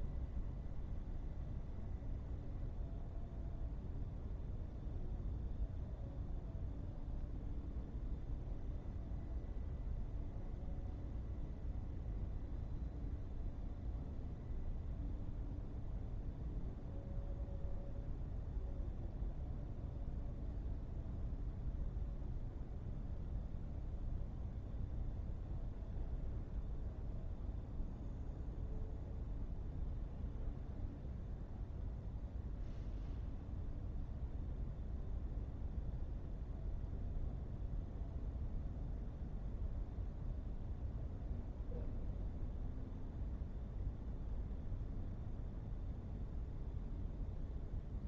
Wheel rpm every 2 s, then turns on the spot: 0, 0, 0, 0, 0, 0, 0, 0, 0, 0, 0, 0, 0, 0, 0, 0, 0, 0, 0, 0, 0, 0, 0, 0.
none